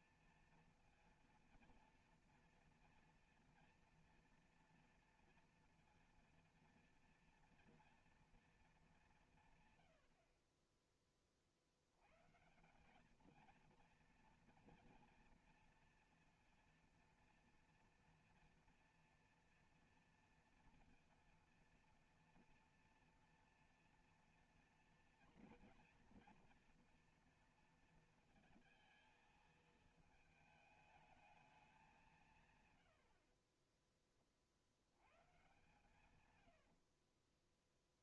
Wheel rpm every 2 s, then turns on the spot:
230, 230, 230, 230, 220, 20, 190, 230, 230, 240, 230, 230, 230, 230, 220, 220, 110, 80, 70.
32-34 36-38